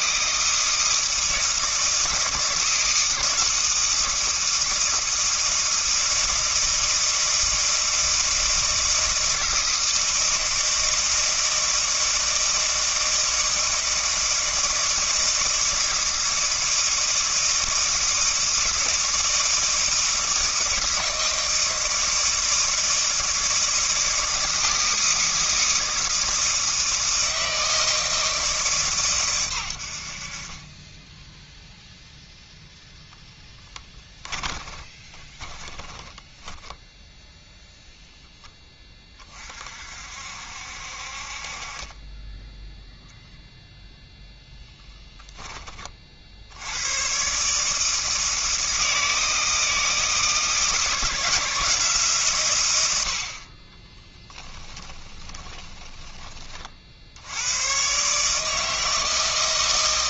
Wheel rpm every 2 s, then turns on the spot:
160, 160, 160, 160, 160, 160, 160, 160, 160, 160, 160, 160, 160, 160, 150, 30, 0, 30, 10, 20, 60, 0, 0, 90, 160, 160, 100, 10, 50, 160.
34-38 54-56